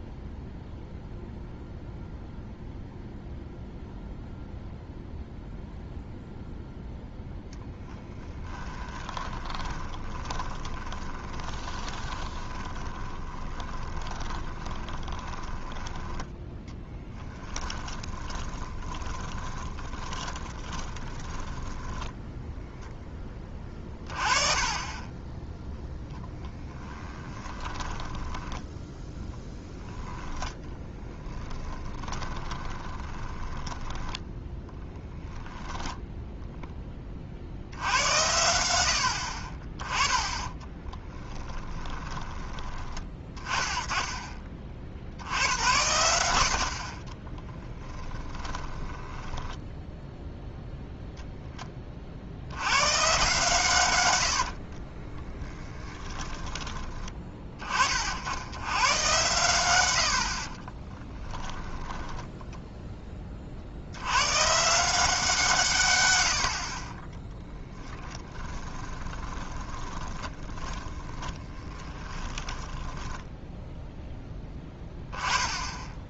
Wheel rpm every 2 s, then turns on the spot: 0, 0, 0, 0, 10, 20, 20, 20, 10, 20, 20, 0, 30, 10, 10, 10, 20, 10, 10, 80, 20, 20, 40, 60, 20, 0, 110, 50, 20, 100, 30, 10, 150, 50, 20, 20, 10, 10.
8-16 18-22 26-36 40-42 46-50 54-56 60-62 68-74